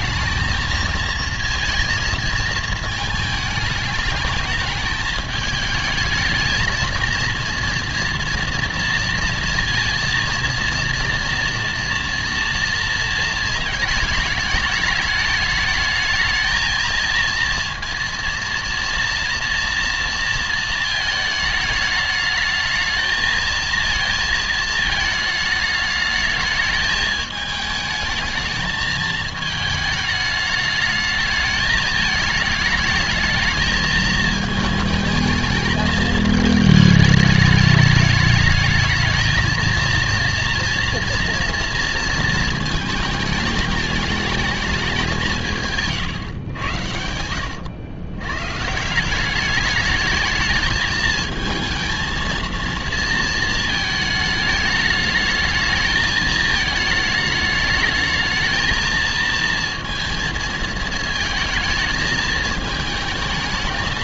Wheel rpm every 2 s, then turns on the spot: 230, 220, 220, 230, 230, 230, 230, 220, 220, 230, 230, 220, 220, 210, 220, 210, 210, 220, 220, 210, 230, 220, 210, 110, 140, 220, 230, 210, 220, 220, 220, 220.
none